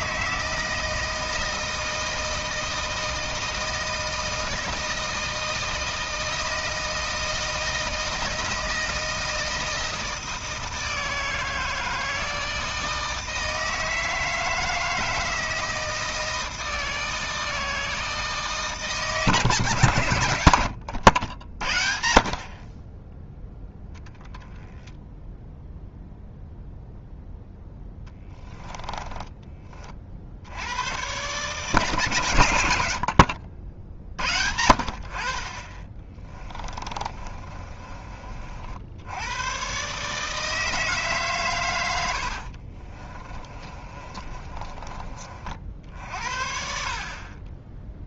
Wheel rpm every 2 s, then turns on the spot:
160, 160, 160, 160, 160, 160, 160, 160, 160, 160, 90, 20, 0, 0, 10, 100, 70, 70, 30, 70, 150, 40, 30, 50.
28-30 36-38 42-48